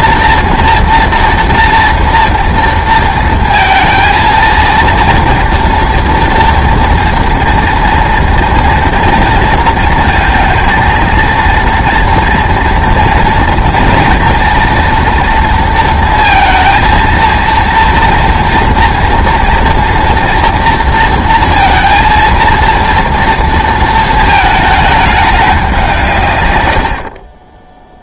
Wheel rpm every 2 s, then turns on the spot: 230, 230, 230, 230, 230, 220, 230, 230, 230, 230, 230, 230, 220, 90.
none